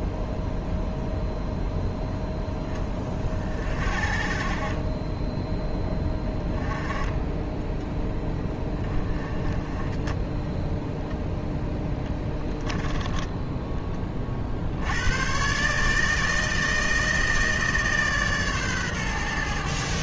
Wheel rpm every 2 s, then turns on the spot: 0, 20, 30, 10, 20, 10, 10, 80, 160, 130.
none